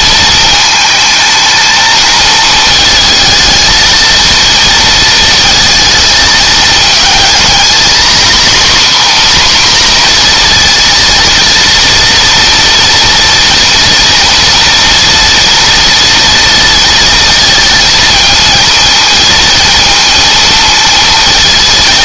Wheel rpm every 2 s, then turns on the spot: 220, 220, 220, 220, 260, 230, 230, 230, 230, 230, 230.
none